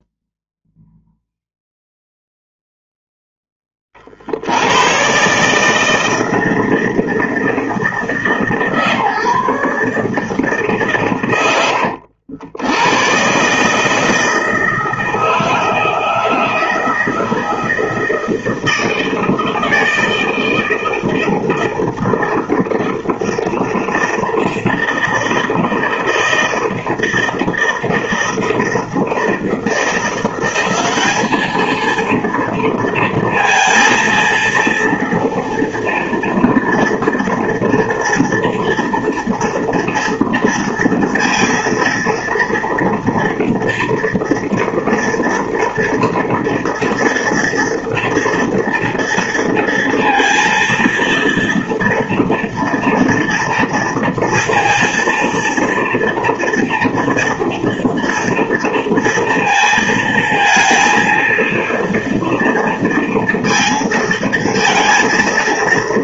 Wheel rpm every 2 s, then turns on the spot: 0, 0, 130, 160, 150, 130, 110, 160, 160, 160, 160, 160, 160, 160, 160, 200, 230, 230, 230, 230, 230, 230, 230, 230, 230, 230, 230, 230, 230, 230, 230, 230, 230.
none